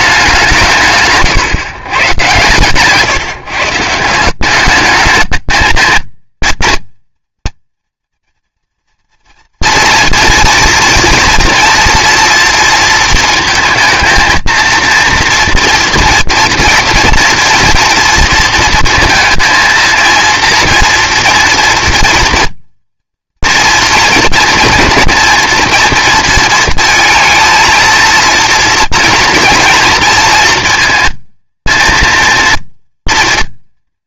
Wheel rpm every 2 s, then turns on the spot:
170, 130, 200, 230, 240, 230, 230, 230, 230, 230, 230, 230, 230, 230, 230, 220, 230.
none